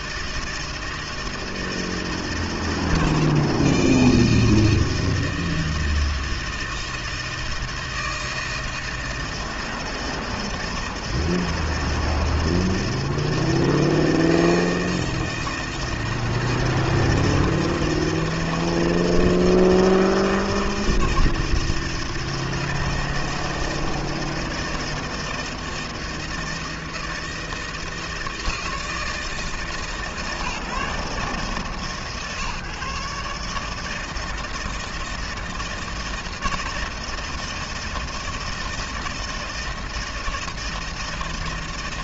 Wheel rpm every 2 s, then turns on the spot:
160, 160, 160, 160, 160, 160, 160, 160, 160, 160, 160, 160, 160, 160, 160, 150, 150, 160, 160, 160, 160.
none